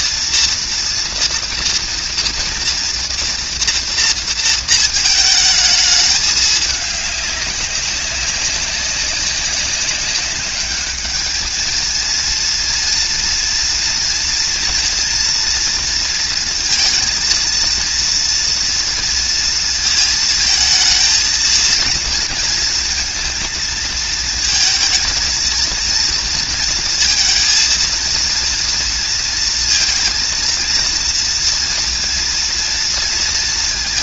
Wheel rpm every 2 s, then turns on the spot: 240, 230, 230, 210, 190, 200, 230, 230, 230, 230, 220, 230, 230, 230, 230, 230, 230.
none